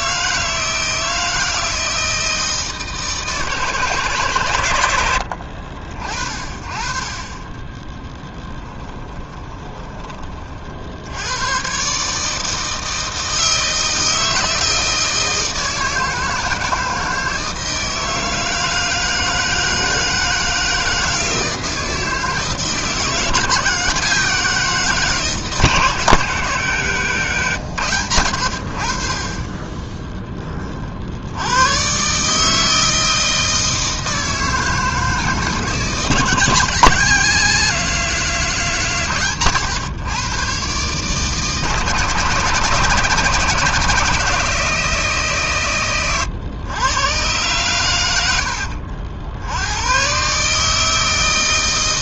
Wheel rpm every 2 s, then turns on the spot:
160, 160, 110, 40, 10, 50, 160, 160, 160, 160, 160, 160, 170, 160, 80, 20, 160, 160, 160, 160, 130, 150, 170, 110, 70, 150.
8-10